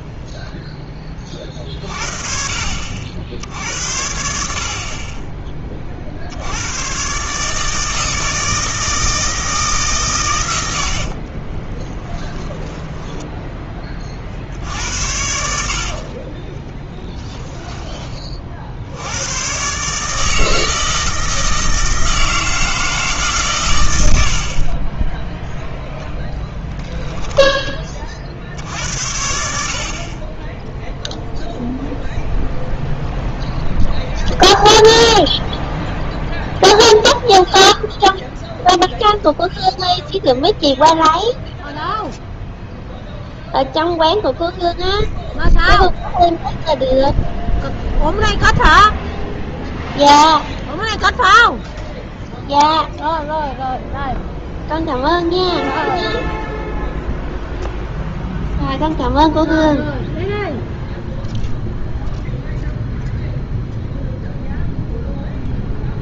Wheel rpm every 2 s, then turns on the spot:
10, 50, 60, 100, 160, 90, 10, 70, 20, 60, 160, 160, 30, 10, 80, 10, 0, 0, 0, 0, 0, 0, 0, 0, 0, 0, 0, 0, 0, 0, 0, 0, 0.
12-14 16-18 26-28